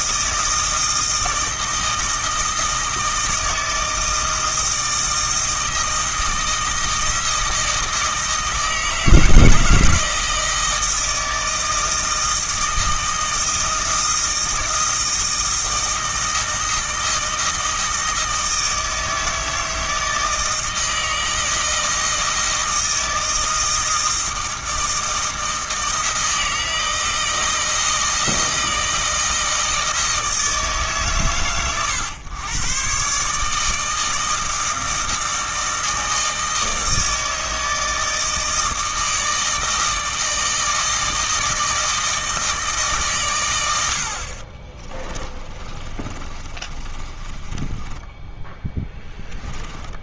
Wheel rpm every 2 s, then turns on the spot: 160, 160, 160, 160, 160, 160, 160, 160, 160, 160, 160, 160, 160, 160, 160, 150, 120, 160, 160, 160, 160, 150, 30, 30, 10.
44-50